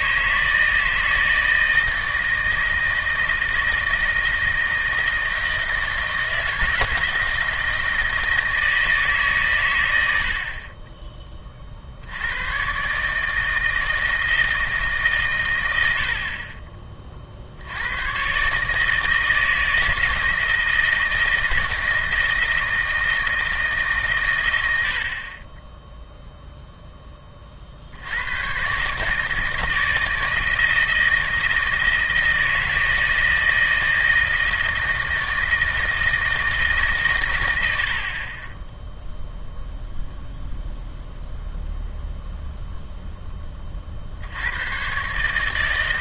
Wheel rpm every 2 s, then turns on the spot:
150, 160, 160, 160, 160, 40, 110, 160, 30, 140, 160, 160, 90, 0, 140, 160, 160, 160, 150, 10, 0, 0, 110.
none